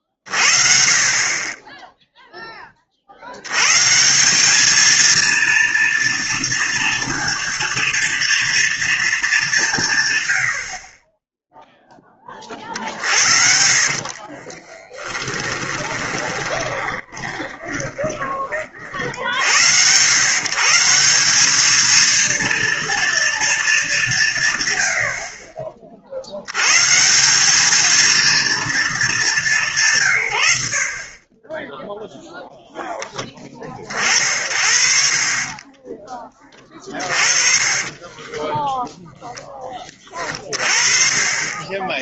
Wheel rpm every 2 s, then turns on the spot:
50, 30, 210, 230, 230, 50, 50, 20, 20, 40, 150, 230, 110, 110, 210, 70, 0, 50, 20, 10, 30.
12-18 38-40